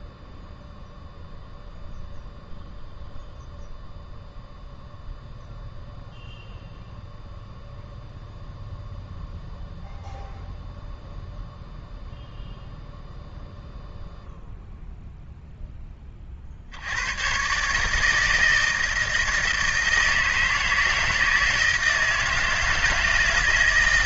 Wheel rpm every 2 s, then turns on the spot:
0, 0, 0, 0, 0, 0, 0, 0, 60, 160, 160, 160.
none